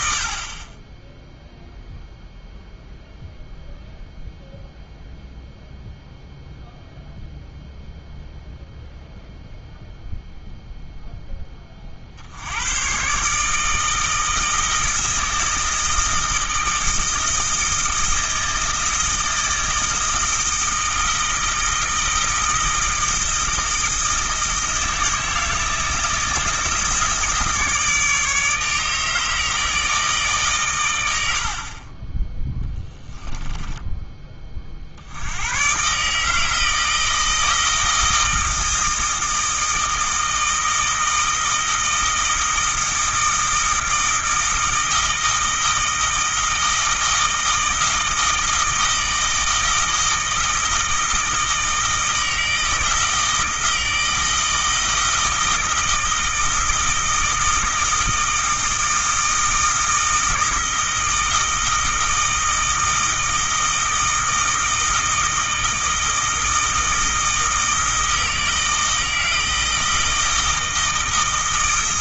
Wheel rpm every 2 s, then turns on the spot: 20, 0, 0, 0, 0, 0, 100, 160, 160, 160, 160, 160, 160, 160, 150, 120, 10, 50, 160, 160, 160, 160, 160, 160, 160, 160, 160, 160, 160, 160, 160, 160, 160, 160, 160, 160.
32-34